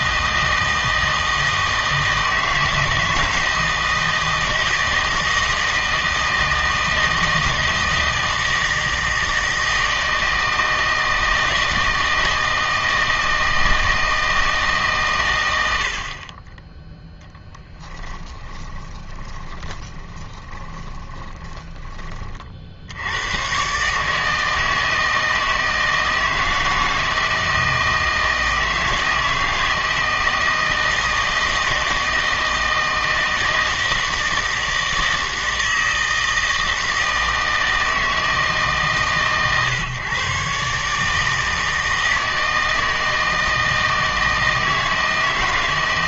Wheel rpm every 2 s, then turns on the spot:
160, 160, 160, 160, 160, 160, 160, 140, 10, 20, 20, 70, 160, 160, 160, 160, 160, 160, 160, 150, 150, 160, 160.
18-22